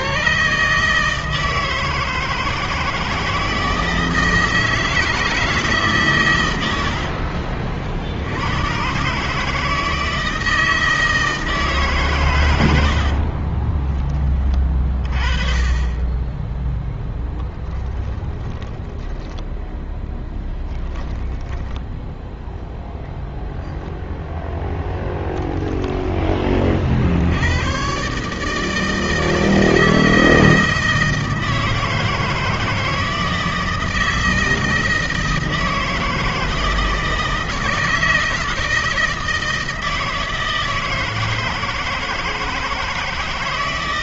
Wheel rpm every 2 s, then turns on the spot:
150, 160, 160, 100, 90, 160, 110, 20, 10, 10, 10, 0, 0, 20, 150, 160, 160, 160, 160, 160, 160, 160.
20-22